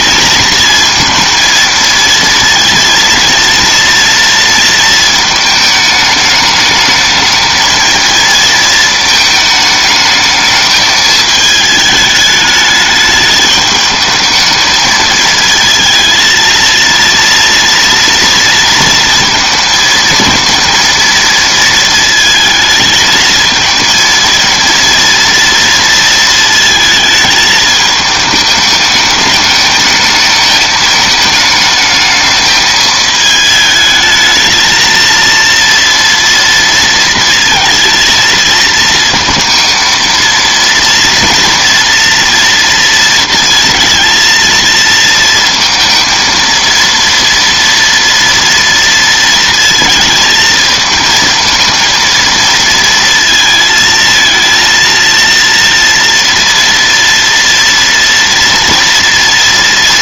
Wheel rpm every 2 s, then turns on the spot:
230, 230, 220, 220, 220, 220, 210, 220, 230, 230, 230, 220, 230, 220, 210, 220, 220, 230, 230, 220, 240, 230, 230, 230, 230, 220, 230, 230, 230, 230.
none